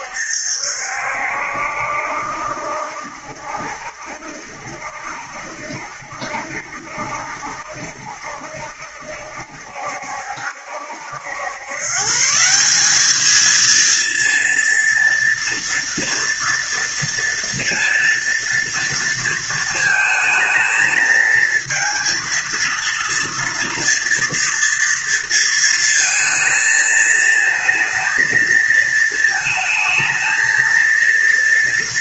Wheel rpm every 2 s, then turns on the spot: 70, 70, 70, 70, 70, 70, 160, 230, 230, 230, 220, 230, 230, 230, 220, 230.
none